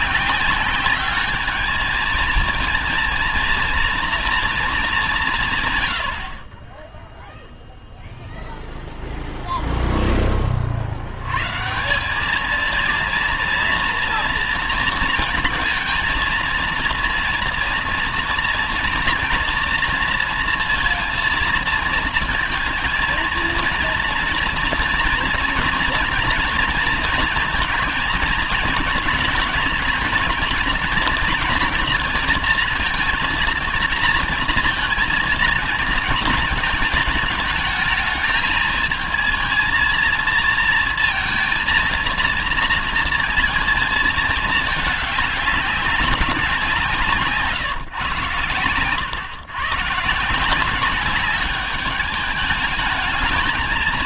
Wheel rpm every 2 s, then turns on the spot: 190, 230, 230, 30, 0, 30, 210, 230, 230, 230, 230, 220, 230, 230, 220, 230, 230, 230, 220, 220, 230, 230, 220, 180, 120, 170, 210.
6-8